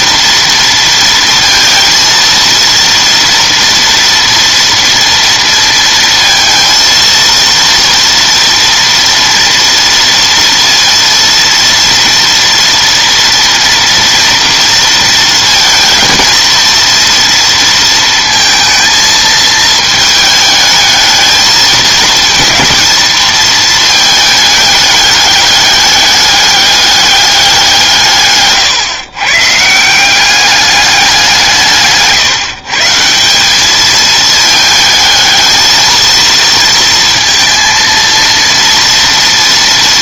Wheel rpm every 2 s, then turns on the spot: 230, 230, 230, 230, 230, 230, 230, 230, 230, 230, 220, 230, 210, 200, 130, 200, 150, 220, 230, 230.
none